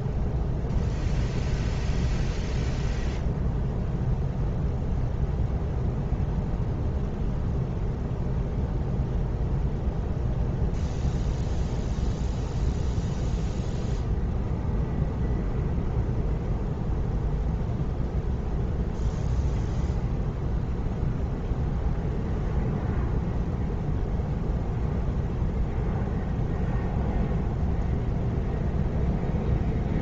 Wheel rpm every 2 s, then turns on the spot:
0, 0, 0, 0, 0, 0, 0, 0, 0, 0, 0, 0, 0, 0, 0.
none